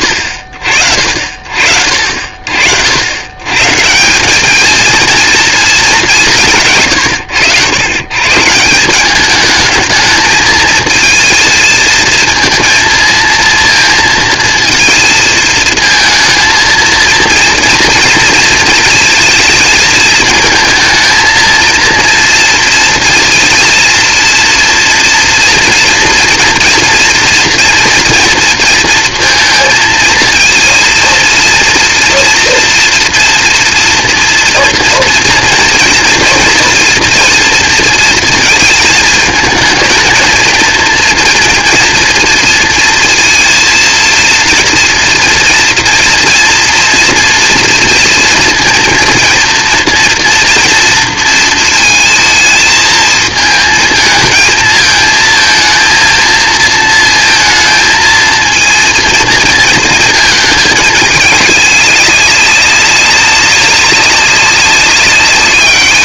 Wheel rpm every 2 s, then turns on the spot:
50, 90, 220, 140, 180, 220, 230, 230, 230, 220, 220, 230, 230, 230, 230, 230, 240, 230, 230, 220, 230, 230, 230, 240, 230, 230, 220, 220, 230, 230, 210, 200, 200.
none